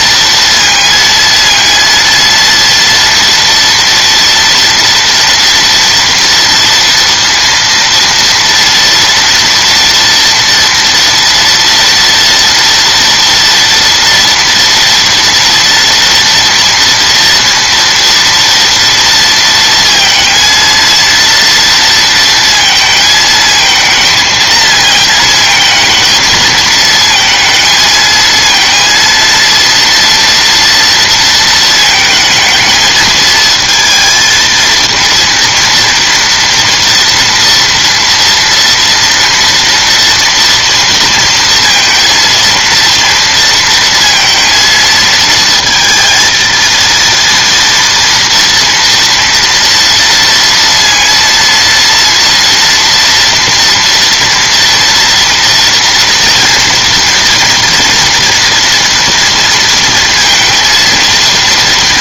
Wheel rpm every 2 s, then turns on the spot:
230, 230, 230, 230, 230, 230, 230, 240, 230, 230, 230, 230, 220, 220, 230, 230, 220, 220, 230, 230, 230, 230, 230, 230, 230, 230, 230, 230, 230, 230, 230.
none